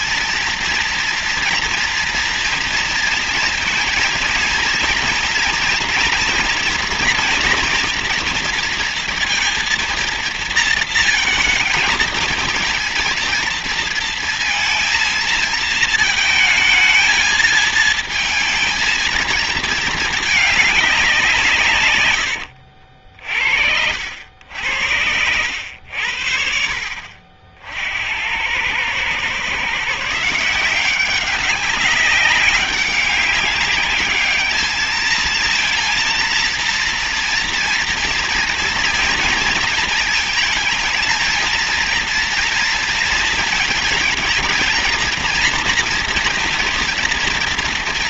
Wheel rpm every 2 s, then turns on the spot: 230, 230, 230, 240, 230, 230, 230, 230, 220, 220, 190, 60, 90, 50, 120, 190, 200, 220, 230, 230, 230, 230, 230, 230.
none